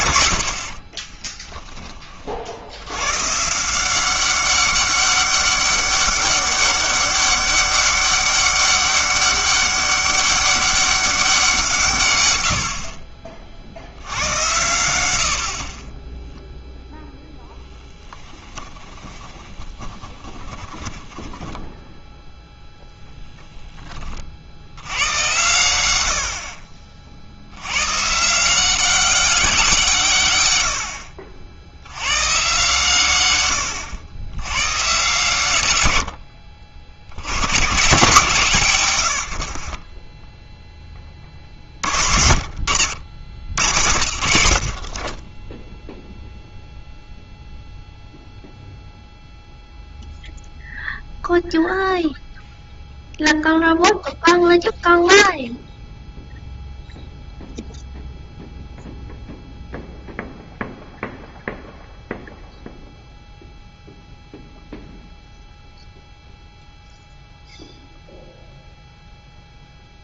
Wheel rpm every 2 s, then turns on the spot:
50, 80, 200, 200, 200, 200, 70, 110, 0, 20, 10, 0, 90, 50, 180, 100, 130, 110, 60, 120, 10, 80, 50, 0, 0, 0, 0, 0, 0, 0, 0, 0, 0, 0, 0.
0-2 18-22